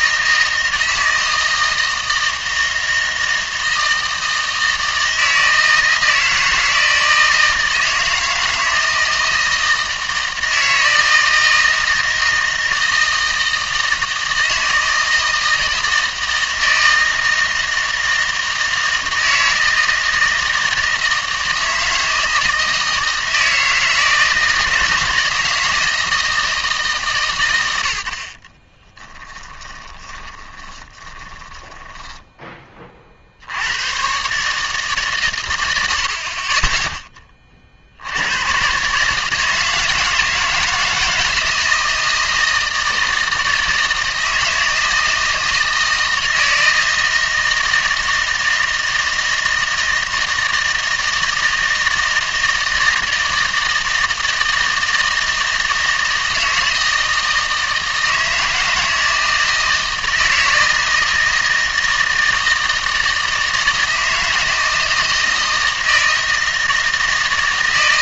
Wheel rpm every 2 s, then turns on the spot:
160, 160, 160, 160, 160, 160, 160, 160, 160, 160, 160, 160, 160, 160, 30, 20, 20, 140, 20, 130, 160, 160, 160, 160, 160, 160, 160, 160, 160, 160, 160, 160, 160, 160.
28-32